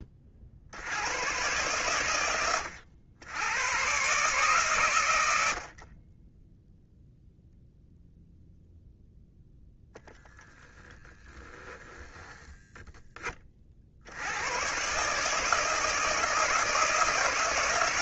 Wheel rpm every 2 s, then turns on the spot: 90, 80, 120, 0, 10, 30, 20, 120, 160.
10-14